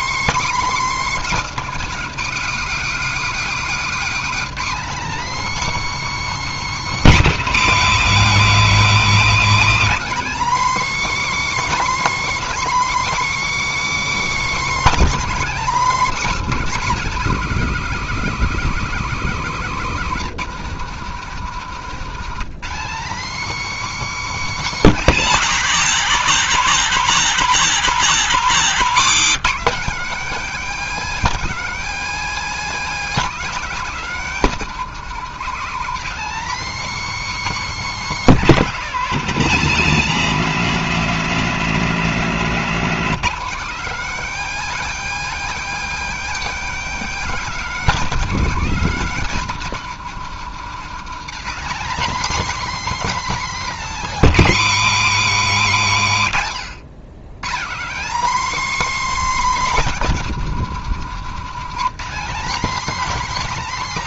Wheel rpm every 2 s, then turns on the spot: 280, 250, 270, 290, 240, 290, 310, 310, 280, 250, 200, 220, 260, 190, 190, 270, 280, 240, 280, 230, 210, 220, 280, 270, 250, 200, 270, 220, 120, 290, 220, 250.
42-44